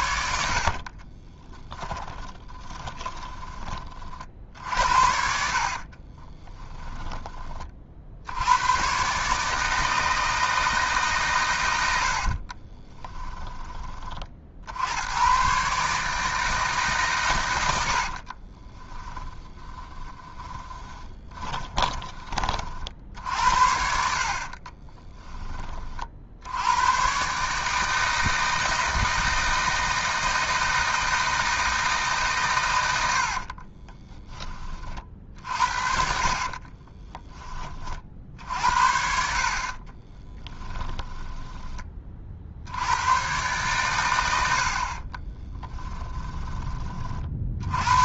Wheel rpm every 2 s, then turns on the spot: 50, 20, 70, 20, 110, 150, 20, 90, 150, 20, 20, 50, 20, 110, 160, 160, 110, 40, 30, 60, 10, 80, 60, 30.
0-4 6-8 12-14 18-22 24-26 36-38 40-42